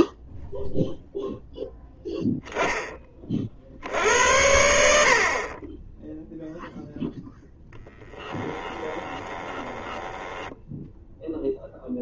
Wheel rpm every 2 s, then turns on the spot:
0, 80, 0, 10, 10, 0.
6-10